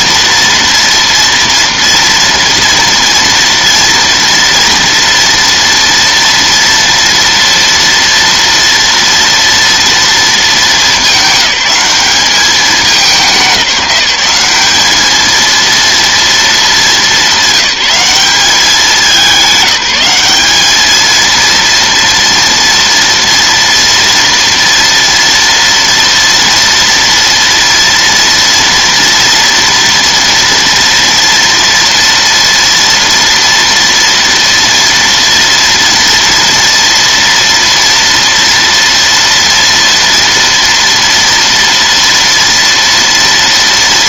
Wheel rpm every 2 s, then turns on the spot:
230, 230, 230, 230, 230, 210, 200, 200, 220, 200, 210, 230, 230, 230, 230, 230, 240, 230, 230, 230, 230, 230.
none